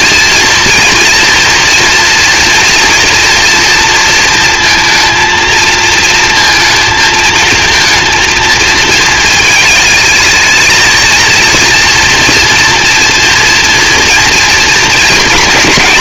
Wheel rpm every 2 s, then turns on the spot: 230, 230, 230, 230, 220, 230, 230, 240.
none